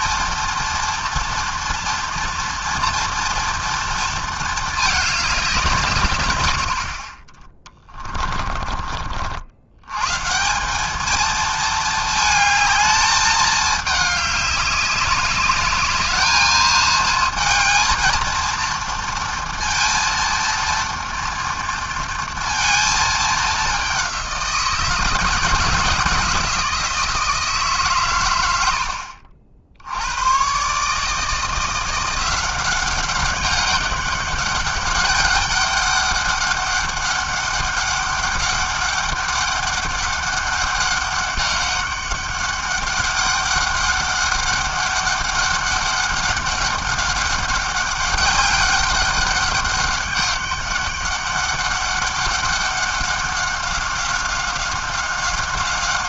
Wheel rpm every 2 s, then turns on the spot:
230, 230, 190, 20, 70, 220, 220, 200, 220, 230, 230, 210, 160, 160, 60, 160, 200, 200, 200, 200, 200, 200, 200, 200, 200, 200, 190, 190.
none